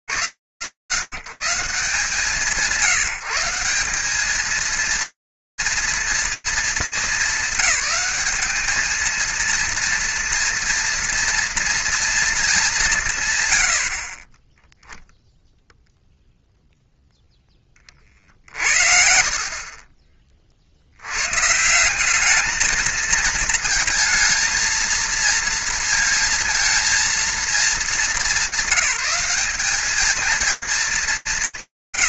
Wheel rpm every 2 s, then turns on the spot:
80, 120, 170, 230, 210, 220, 230, 140, 0, 20, 40, 170, 220, 230, 210, 210.
none